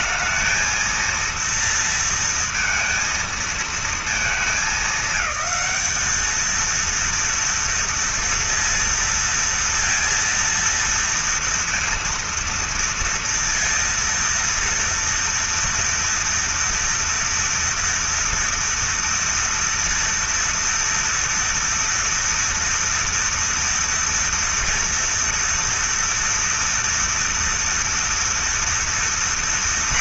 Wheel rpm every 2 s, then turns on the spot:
230, 230, 220, 230, 230, 230, 230, 230, 230, 230, 230, 230, 230, 230, 230.
none